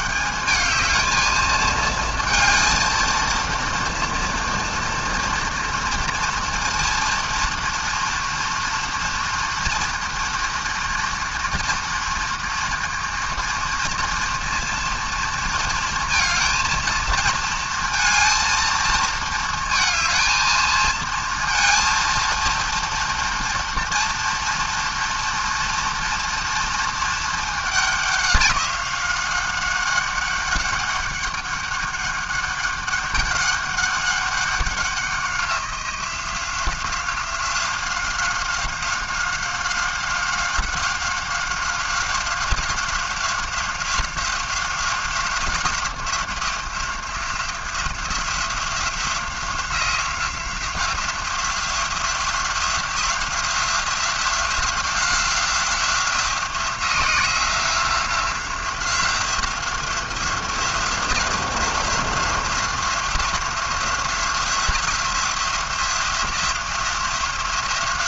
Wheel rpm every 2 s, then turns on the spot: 220, 230, 230, 230, 230, 230, 230, 230, 230, 220, 230, 230, 230, 220, 190, 200, 200, 180, 180, 190, 190, 180, 190, 180, 180, 180, 180, 180, 180, 180, 180, 180, 170, 180.
none